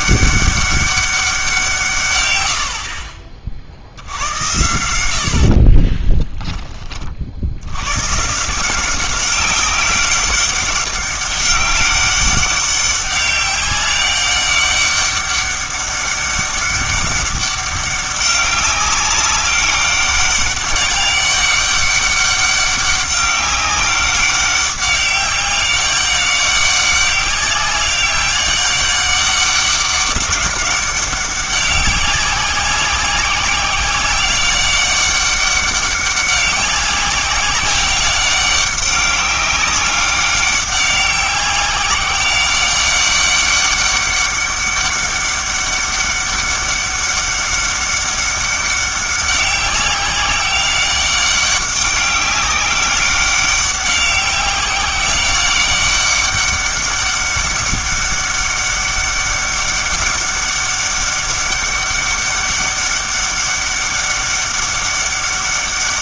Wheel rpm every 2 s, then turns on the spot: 200, 80, 90, 20, 170, 200, 200, 200, 200, 200, 200, 200, 190, 200, 200, 200, 190, 200, 190, 200, 190, 190, 200, 200, 200, 190, 200, 190, 200, 200, 200, 200, 200.
none